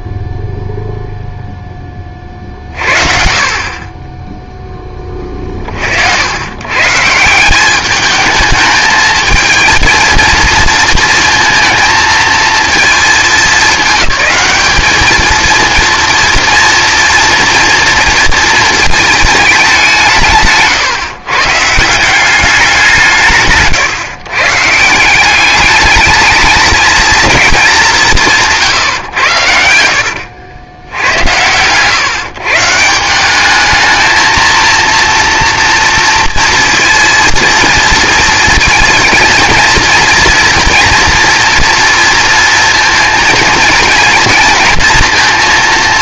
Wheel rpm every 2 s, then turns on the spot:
0, 40, 20, 150, 220, 230, 220, 220, 230, 220, 140, 170, 180, 220, 110, 100, 190, 230, 230, 230, 230, 230, 230.
none